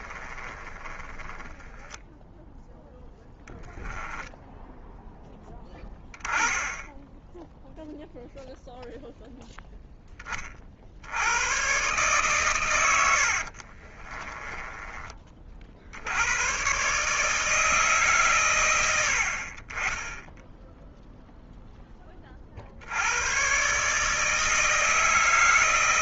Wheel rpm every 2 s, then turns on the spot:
30, 10, 0, 0, 0, 80, 90, 30, 140, 80, 0, 90, 160.
0-2 12-14